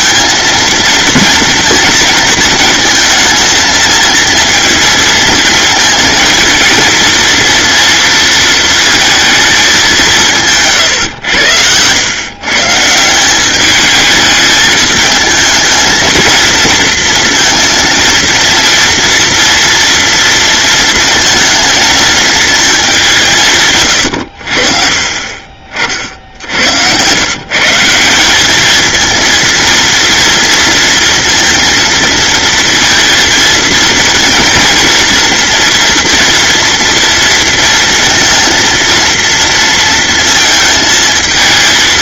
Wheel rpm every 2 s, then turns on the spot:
230, 230, 230, 220, 230, 140, 160, 220, 230, 230, 230, 200, 50, 90, 220, 230, 230, 230, 230, 230, 220.
none